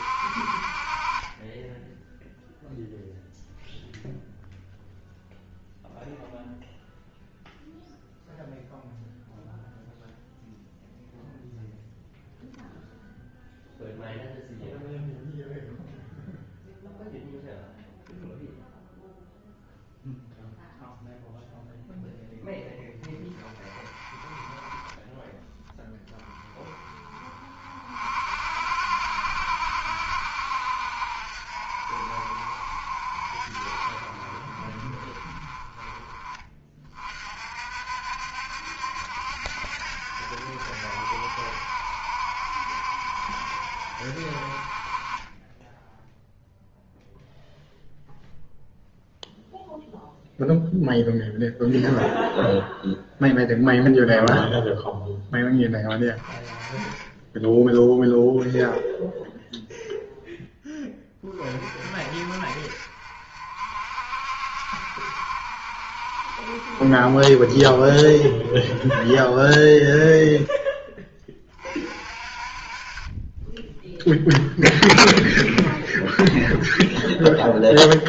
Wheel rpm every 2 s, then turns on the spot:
40, 0, 0, 0, 0, 0, 0, 0, 0, 0, 0, 10, 10, 20, 60, 60, 60, 30, 30, 70, 70, 70, 30, 0, 0, 0, 0, 0, 20, 0, 20, 50, 50, 50, 20, 10, 30, 0, 0.
none